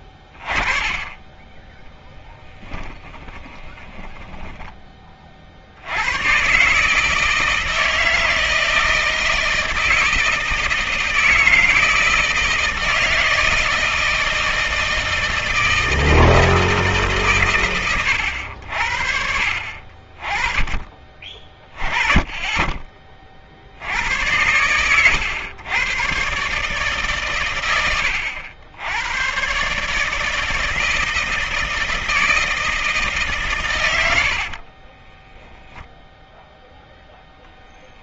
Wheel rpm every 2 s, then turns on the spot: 20, 30, 20, 140, 160, 160, 160, 160, 150, 80, 30, 20, 110, 140, 100, 160, 160, 40, 0.
2-4 34-36